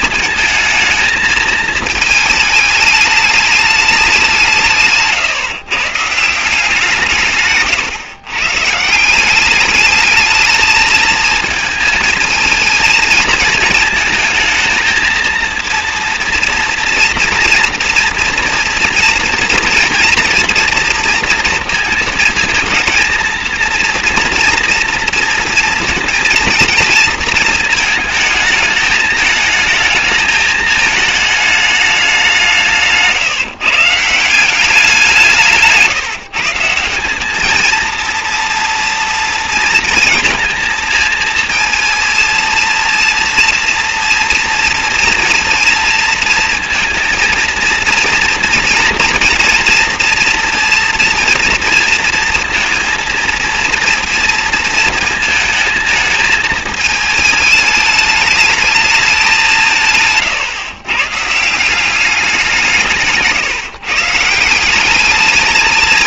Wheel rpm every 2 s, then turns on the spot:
220, 210, 150, 160, 160, 220, 220, 220, 230, 230, 230, 230, 230, 230, 220, 220, 160, 180, 180, 230, 220, 230, 230, 230, 230, 230, 230, 230, 220, 200, 130, 160, 200.
none